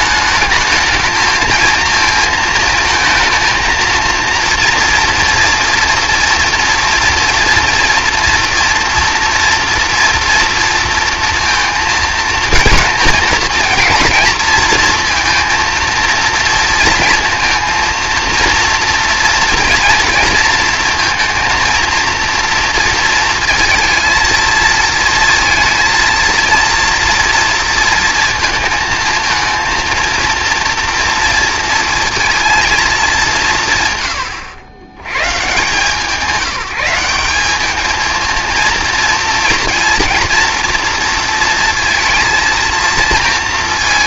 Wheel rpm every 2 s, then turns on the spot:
220, 230, 240, 230, 230, 230, 230, 230, 230, 230, 230, 230, 230, 230, 230, 230, 210, 110, 180, 230, 230, 230.
none